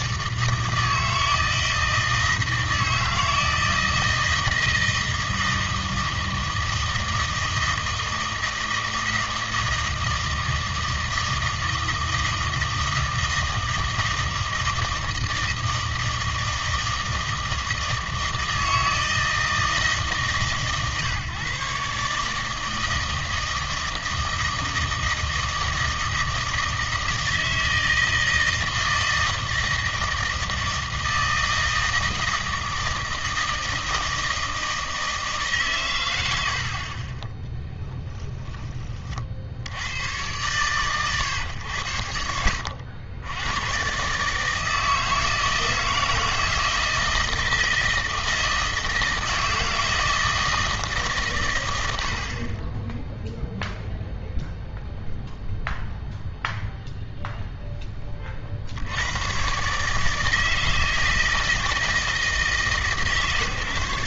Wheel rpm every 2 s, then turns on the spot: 160, 160, 160, 160, 160, 160, 160, 160, 160, 160, 150, 160, 160, 160, 160, 160, 160, 160, 70, 20, 110, 80, 160, 160, 160, 160, 30, 0, 0, 60, 160, 160.
none